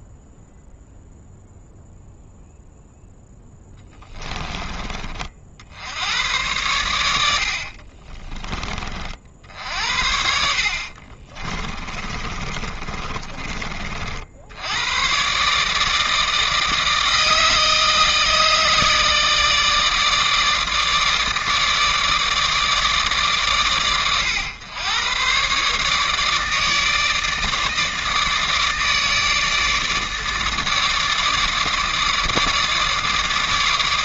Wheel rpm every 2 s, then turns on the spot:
0, 0, 20, 110, 30, 60, 30, 90, 160, 160, 150, 150, 110, 150, 150, 150, 150.
10-14